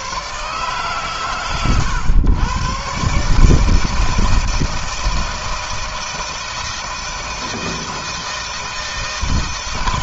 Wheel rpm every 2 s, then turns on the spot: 140, 130, 160, 160, 160.
none